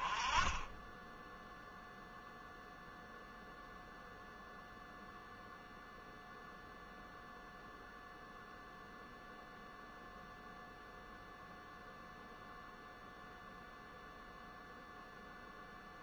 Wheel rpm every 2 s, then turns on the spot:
10, 0, 0, 0, 0, 0, 0, 0.
none